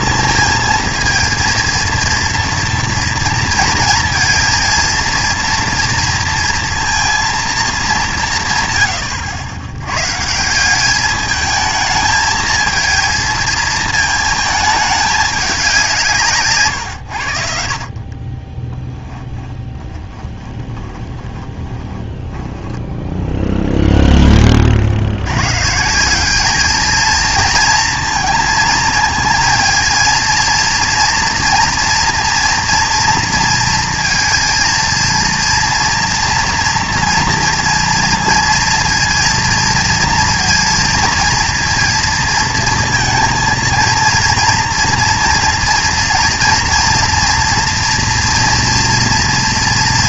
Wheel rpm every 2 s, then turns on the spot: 230, 230, 230, 230, 130, 180, 220, 220, 140, 20, 20, 10, 30, 210, 230, 230, 230, 230, 230, 230, 230, 230, 230, 240, 230.
16-24